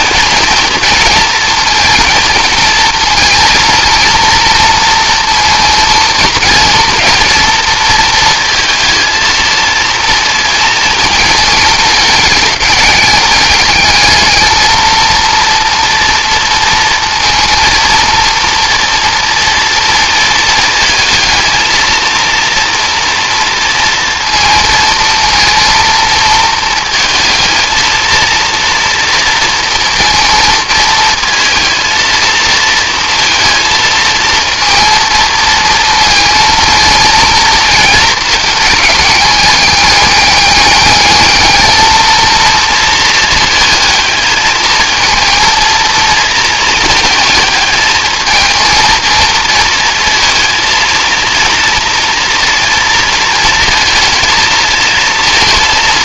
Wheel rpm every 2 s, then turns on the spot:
220, 230, 230, 230, 230, 230, 210, 220, 230, 230, 230, 230, 230, 220, 230, 230, 230, 230, 230, 210, 210, 230, 220, 220, 220, 230, 230, 220.
none